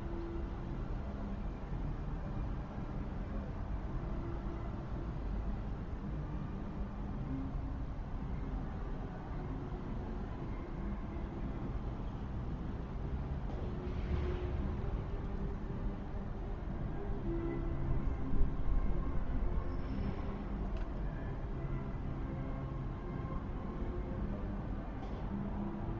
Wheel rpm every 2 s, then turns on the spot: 0, 0, 0, 0, 0, 0, 0, 0, 0, 0, 0, 0, 0.
none